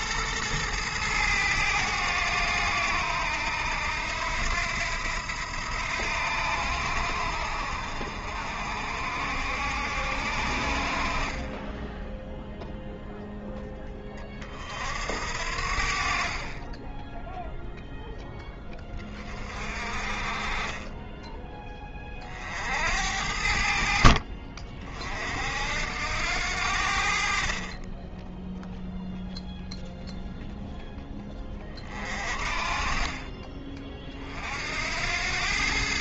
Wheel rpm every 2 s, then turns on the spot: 110, 90, 80, 80, 60, 60, 0, 40, 30, 10, 30, 60, 50, 80, 0, 0, 40, 60.
20-22 32-34